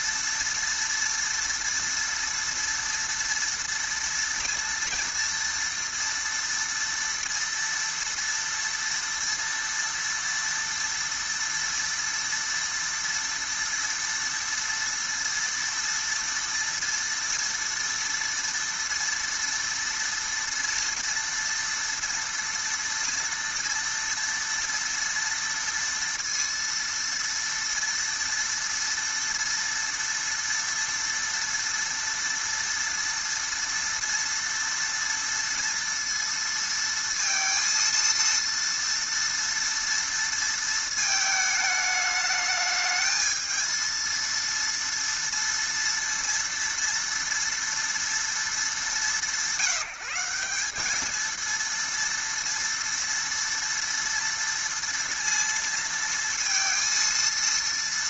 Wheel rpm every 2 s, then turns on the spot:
230, 230, 230, 230, 230, 230, 230, 230, 230, 230, 230, 230, 230, 230, 230, 240, 230, 230, 230, 230, 230, 220, 230, 230, 210, 190, 230, 230, 230.
none